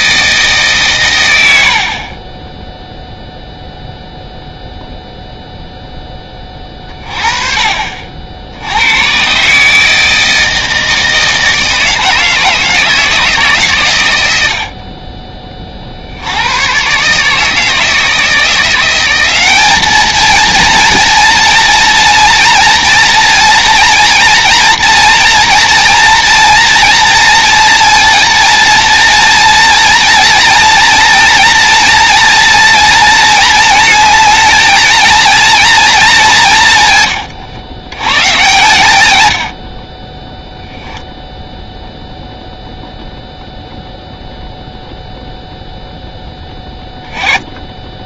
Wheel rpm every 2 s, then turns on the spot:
160, 30, 0, 20, 70, 160, 160, 80, 90, 170, 220, 230, 230, 240, 230, 230, 230, 230, 180, 120, 20, 0, 0, 10.
none